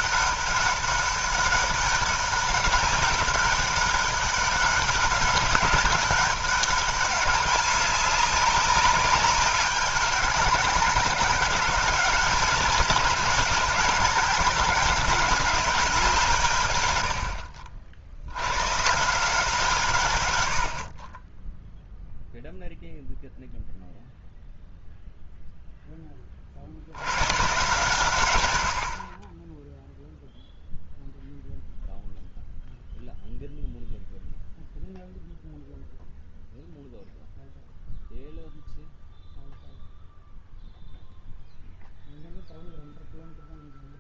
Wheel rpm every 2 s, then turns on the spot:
200, 190, 200, 200, 200, 200, 190, 200, 140, 120, 70, 0, 0, 40, 90, 0, 0, 0, 0, 0, 0, 0.
none